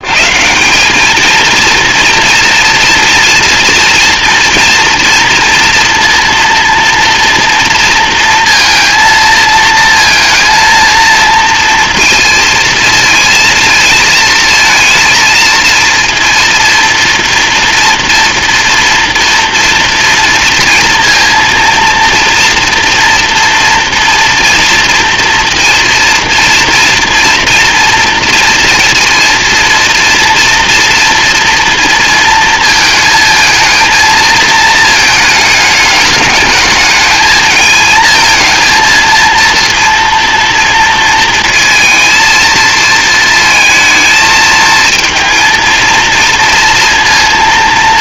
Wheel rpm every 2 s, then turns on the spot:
180, 240, 230, 230, 230, 230, 230, 230, 230, 230, 230, 230, 240, 230, 230, 240, 220, 220, 210, 230, 230, 220, 220, 230.
none